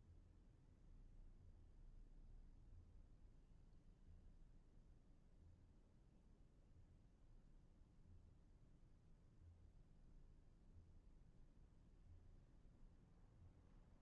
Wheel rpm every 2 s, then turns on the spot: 0, 0, 0, 0, 0, 0, 0.
none